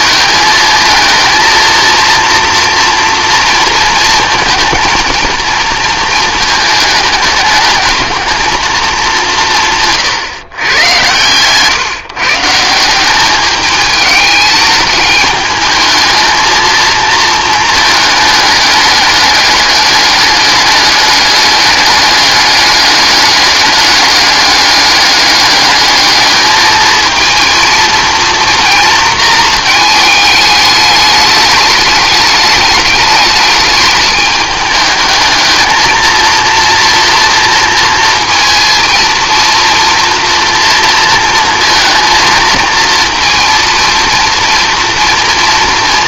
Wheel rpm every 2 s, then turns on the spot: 220, 230, 230, 210, 210, 120, 180, 210, 220, 210, 210, 200, 200, 220, 230, 210, 210, 210, 230, 230, 230, 230, 230.
none